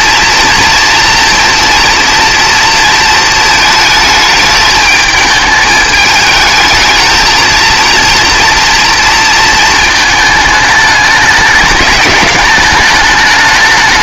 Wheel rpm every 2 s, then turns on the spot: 230, 230, 220, 220, 230, 210, 210.
none